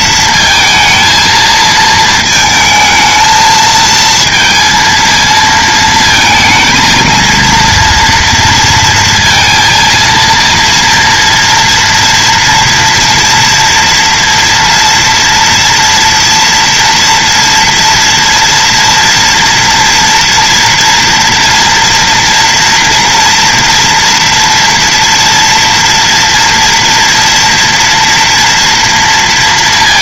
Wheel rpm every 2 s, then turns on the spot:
220, 220, 230, 220, 230, 240, 230, 230, 230, 230, 230, 240, 230, 230, 230.
none